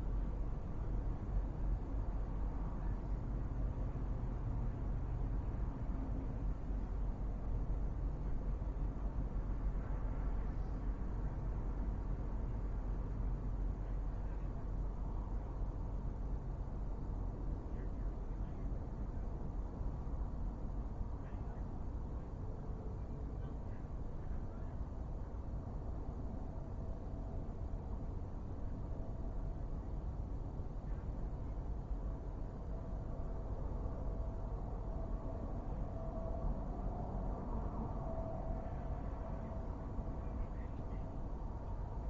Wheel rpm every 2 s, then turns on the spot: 0, 0, 0, 0, 0, 0, 0, 0, 0, 0, 0, 0, 0, 0, 0, 0, 0, 0, 0, 0, 0.
none